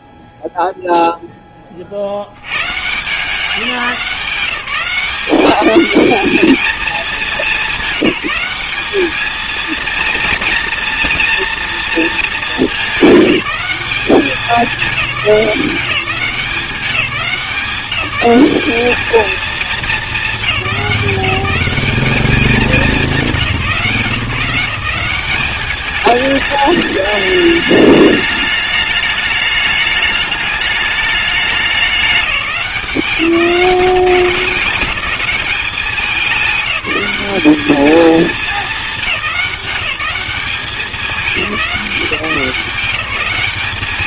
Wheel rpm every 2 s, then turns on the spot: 0, 120, 180, 220, 200, 240, 210, 190, 190, 200, 200, 200, 180, 210, 210, 210, 180, 190, 190, 210, 190, 190.
none